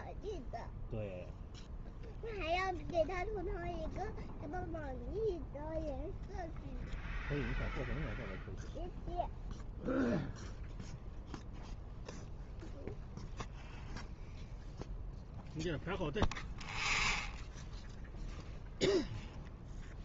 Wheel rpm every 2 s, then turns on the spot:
0, 0, 0, 0, 0, 0, 0, 0, 0, 0.
none